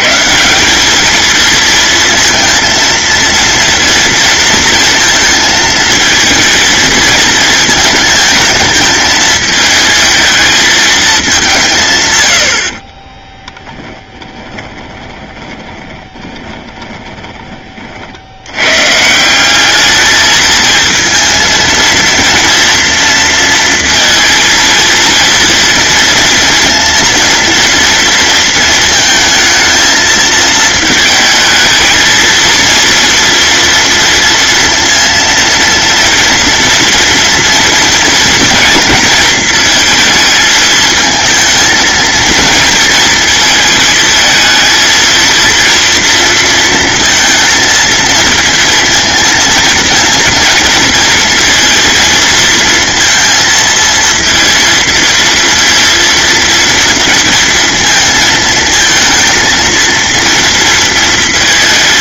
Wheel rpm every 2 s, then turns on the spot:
210, 230, 230, 220, 220, 220, 40, 20, 20, 140, 220, 230, 230, 230, 220, 220, 230, 230, 230, 230, 220, 230, 230, 230, 230, 230, 230, 230, 230, 230, 230.
12-18